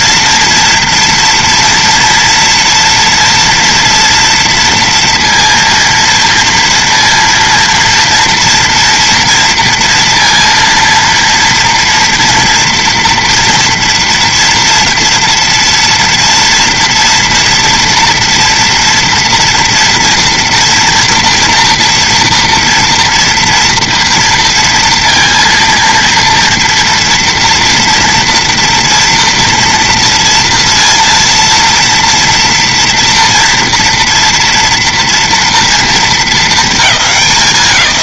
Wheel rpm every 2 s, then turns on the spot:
230, 230, 230, 230, 230, 230, 230, 230, 230, 240, 230, 230, 230, 230, 230, 230, 230, 230, 220.
none